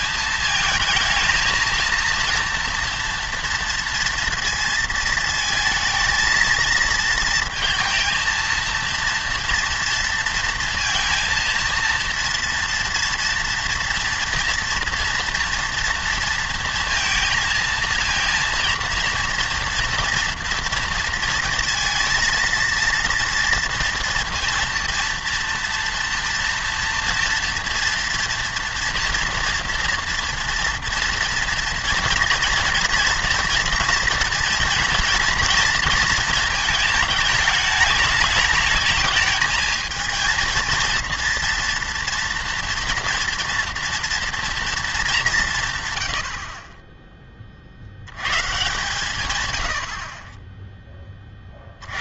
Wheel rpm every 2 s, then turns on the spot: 220, 240, 230, 220, 230, 230, 230, 230, 220, 230, 230, 230, 230, 240, 230, 230, 230, 230, 220, 210, 230, 230, 230, 30, 150, 10.
none